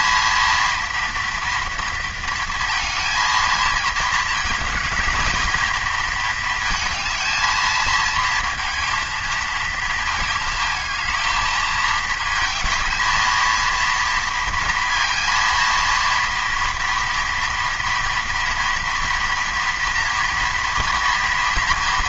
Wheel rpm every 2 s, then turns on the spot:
230, 220, 230, 220, 230, 230, 230, 230, 230, 240, 230.
none